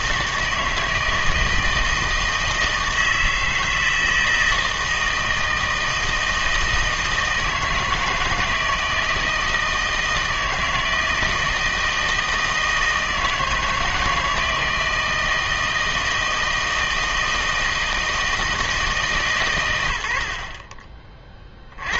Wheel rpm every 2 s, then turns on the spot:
160, 160, 160, 160, 160, 160, 160, 160, 160, 160, 40.
none